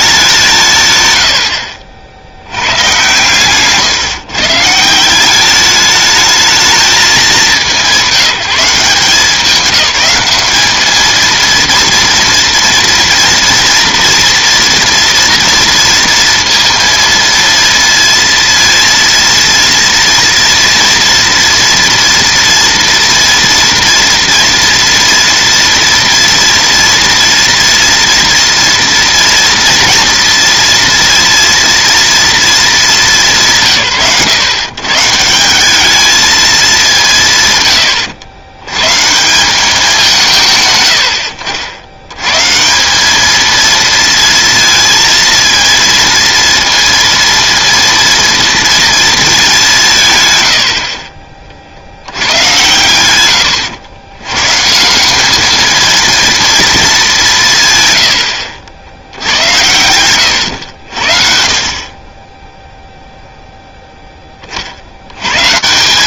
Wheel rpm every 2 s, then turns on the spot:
160, 100, 140, 220, 190, 210, 240, 230, 230, 230, 230, 240, 230, 230, 230, 230, 220, 140, 210, 100, 150, 160, 230, 230, 230, 90, 110, 150, 220, 80, 90, 0, 80.
none